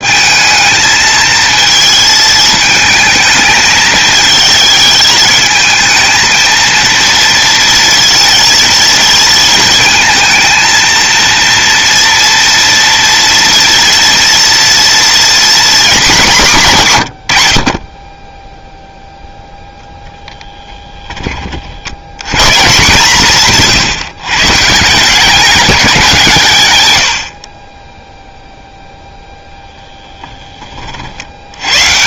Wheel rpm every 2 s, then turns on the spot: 220, 220, 220, 230, 230, 230, 230, 240, 120, 0, 10, 150, 170, 90, 0, 60.
none